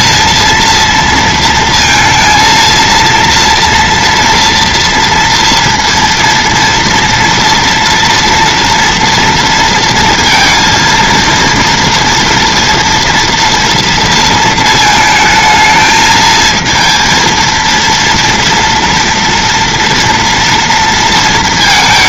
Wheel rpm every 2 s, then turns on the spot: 230, 230, 230, 230, 230, 230, 230, 220, 230, 240, 230.
none